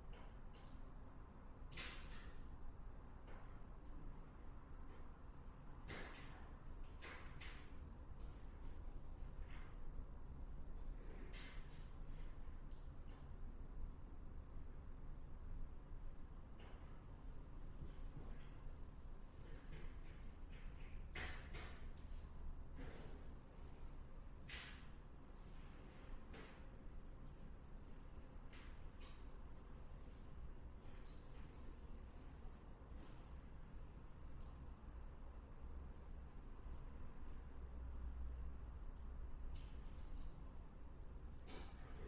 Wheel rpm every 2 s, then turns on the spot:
0, 0, 0, 0, 0, 0, 0, 0, 0, 0, 0, 0, 0, 0, 0, 0, 0, 0, 0, 0, 0.
none